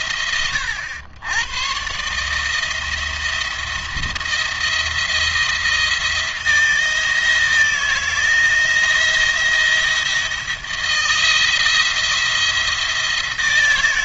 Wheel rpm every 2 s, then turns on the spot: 100, 170, 170, 160, 170, 160, 170.
none